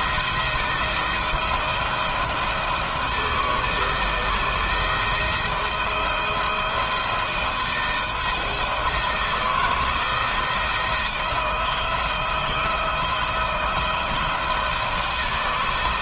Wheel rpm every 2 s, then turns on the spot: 160, 160, 160, 170, 170, 160, 170, 170.
none